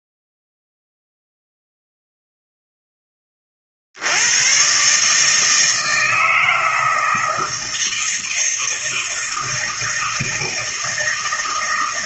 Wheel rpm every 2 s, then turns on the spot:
0, 0, 120, 160, 160, 160.
none